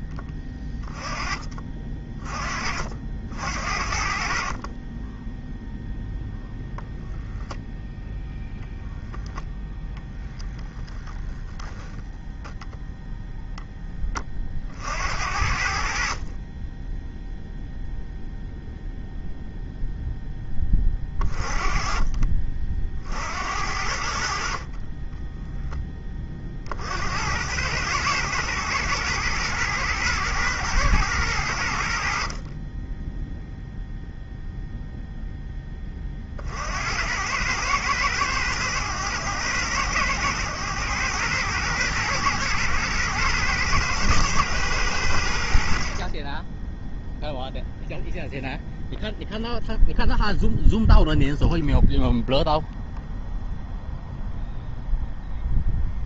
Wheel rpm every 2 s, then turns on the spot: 20, 50, 30, 0, 0, 0, 0, 50, 20, 0, 20, 50, 40, 60, 110, 110, 20, 0, 70, 100, 110, 120, 100, 0, 0, 0, 0, 0.
none